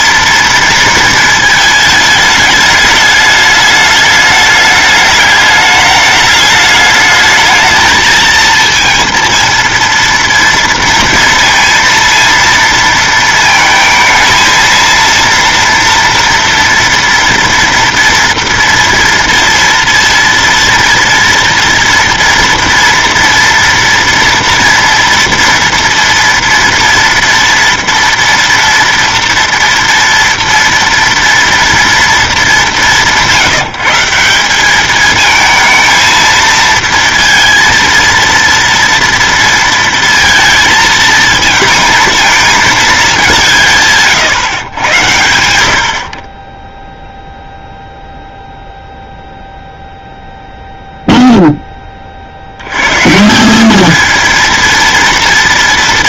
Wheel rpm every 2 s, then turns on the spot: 230, 210, 210, 210, 230, 230, 230, 230, 230, 230, 230, 240, 230, 230, 230, 230, 190, 200, 230, 230, 230, 220, 130, 10, 0, 0, 110, 230.
none